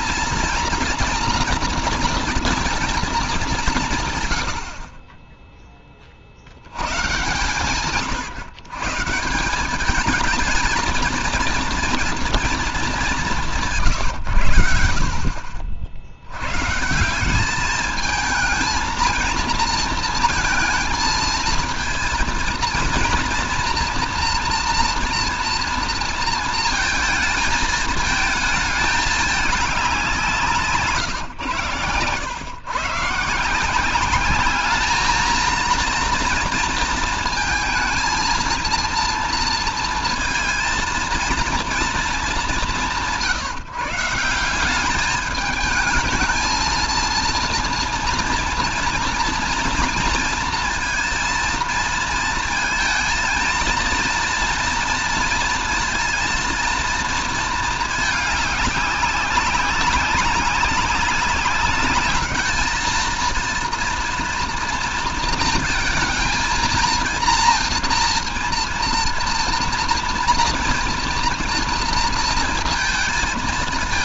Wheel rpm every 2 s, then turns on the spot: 230, 230, 50, 100, 140, 220, 200, 60, 140, 230, 230, 230, 240, 220, 210, 140, 130, 220, 230, 230, 230, 180, 190, 220, 230, 230, 220, 230, 230, 200, 190, 220, 230, 230, 230, 230, 230.
none